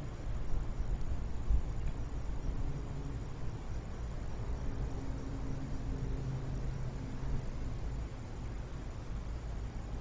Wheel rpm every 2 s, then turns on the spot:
0, 0, 0, 0, 0.
none